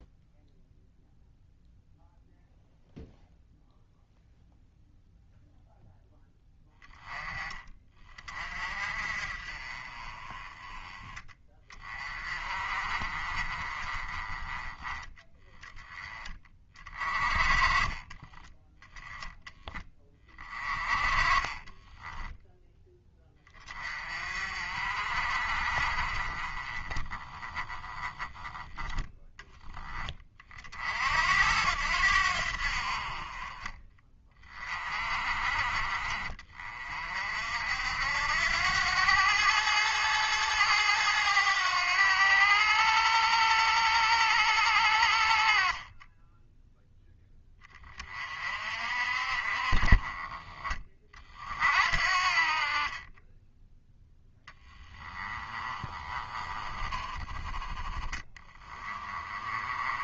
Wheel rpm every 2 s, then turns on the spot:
0, 0, 0, 10, 40, 20, 30, 20, 30, 10, 30, 10, 40, 20, 10, 50, 50, 40, 40, 90, 110, 100, 80, 10, 50, 30, 30, 10, 20, 20.
20-22 28-30 54-60